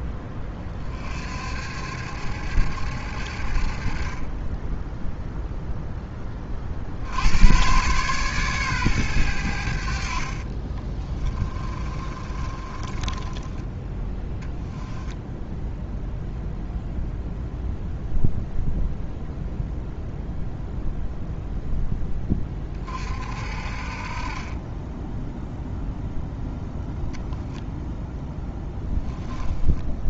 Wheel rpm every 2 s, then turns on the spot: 50, 60, 0, 90, 100, 20, 20, 10, 0, 0, 0, 50, 10, 0, 10.
10-16 28-30